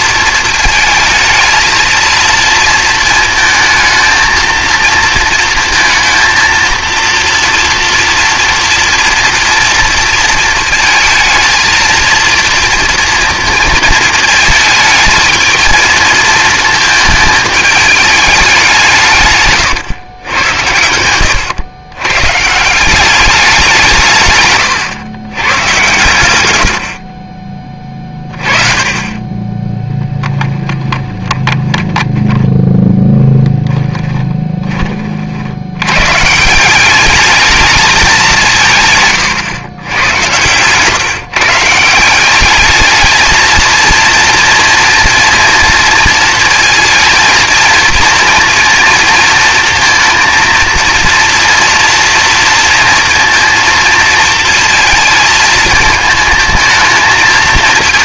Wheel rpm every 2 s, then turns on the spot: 220, 230, 230, 230, 230, 220, 230, 220, 220, 170, 100, 180, 110, 80, 30, 20, 10, 30, 190, 140, 130, 210, 230, 220, 230, 230, 230, 220, 220.
30-34